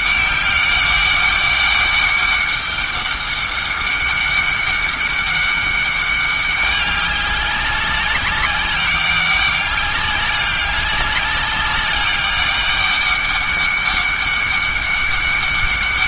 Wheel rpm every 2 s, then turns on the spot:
200, 200, 200, 200, 200, 200, 200, 200.
none